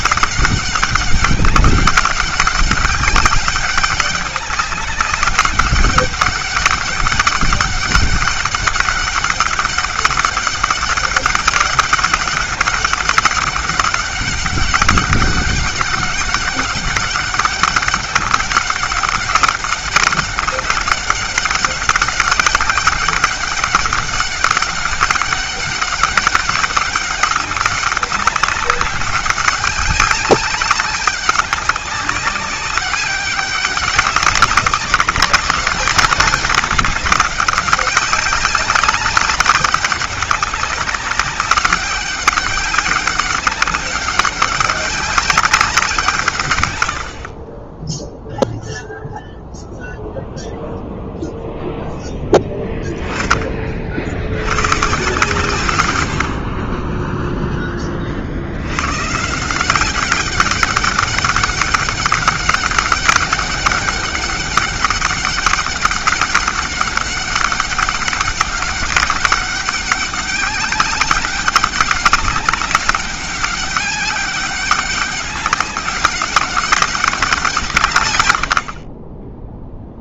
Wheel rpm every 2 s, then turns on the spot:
200, 200, 200, 200, 200, 200, 200, 200, 200, 190, 200, 200, 200, 200, 200, 200, 200, 200, 200, 190, 200, 200, 200, 90, 0, 0, 20, 140, 20, 140, 200, 200, 200, 200, 190, 200, 200, 200, 190, 30.
none